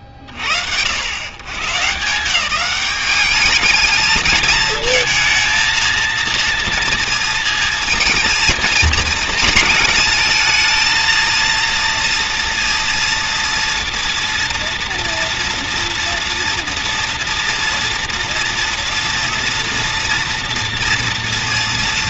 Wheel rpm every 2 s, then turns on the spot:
40, 180, 220, 230, 220, 220, 240, 230, 230, 230, 230.
none